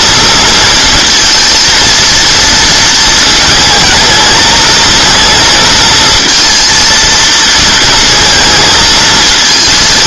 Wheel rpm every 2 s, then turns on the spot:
230, 230, 220, 230, 220.
none